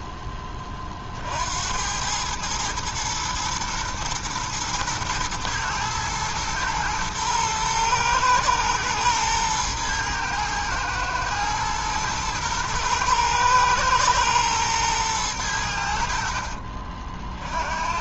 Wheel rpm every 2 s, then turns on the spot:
20, 110, 110, 110, 110, 110, 110, 110, 40.
16-18